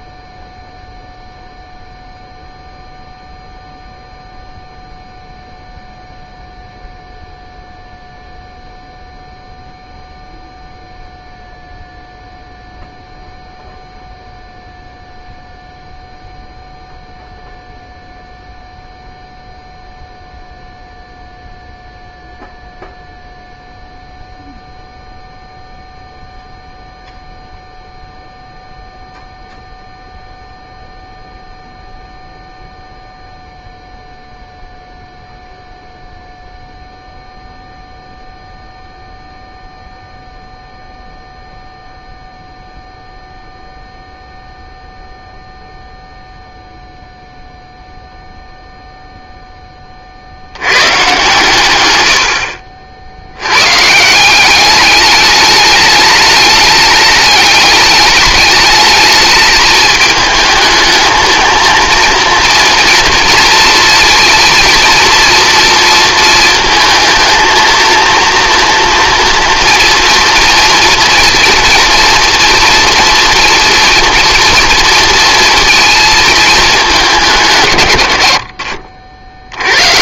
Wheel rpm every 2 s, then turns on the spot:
0, 0, 0, 0, 0, 0, 0, 0, 0, 0, 0, 0, 0, 0, 0, 0, 0, 0, 0, 0, 0, 0, 0, 0, 0, 110, 60, 200, 210, 210, 220, 230, 230, 230, 240, 230, 230, 230, 210, 60.
none